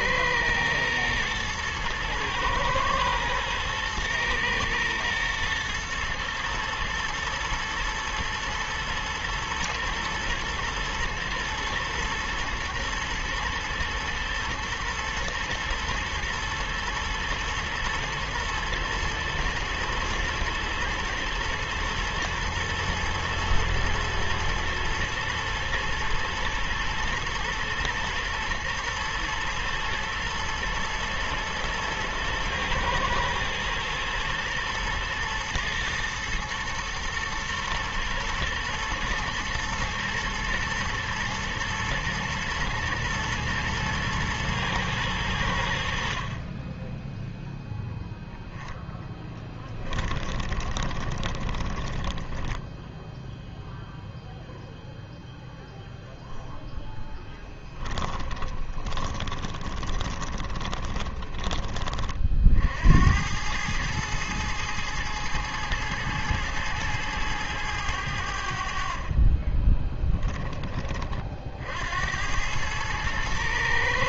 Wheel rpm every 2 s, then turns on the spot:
110, 110, 110, 110, 120, 120, 110, 120, 110, 110, 120, 120, 110, 110, 110, 110, 120, 110, 120, 120, 120, 120, 110, 20, 10, 20, 10, 0, 0, 20, 20, 60, 110, 110, 60, 20, 110.
50-54 58-62